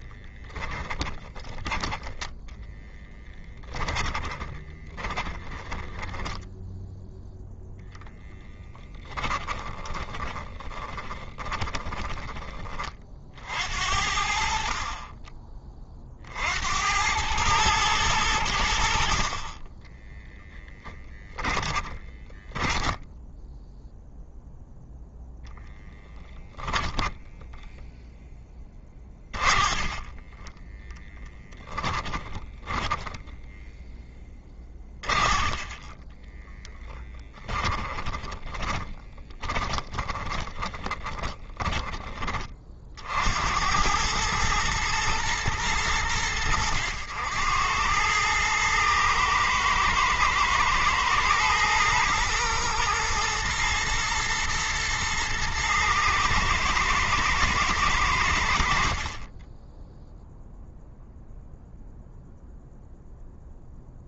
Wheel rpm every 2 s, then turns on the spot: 10, 10, 10, 0, 20, 20, 40, 30, 90, 70, 20, 10, 0, 0, 20, 10, 10, 30, 20, 30, 20, 60, 110, 90, 110, 120, 120, 120, 120, 40, 0, 0.
0-6 8-12 20-24 28-30 32-42